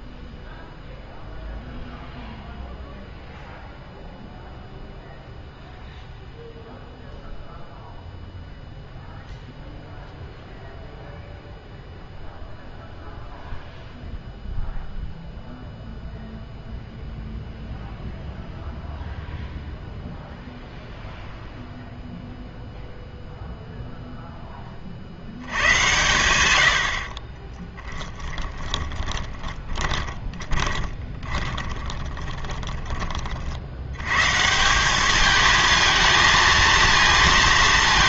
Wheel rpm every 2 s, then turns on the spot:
0, 0, 0, 0, 0, 0, 0, 0, 0, 0, 0, 0, 30, 80, 10, 20, 20, 160, 230.
28-34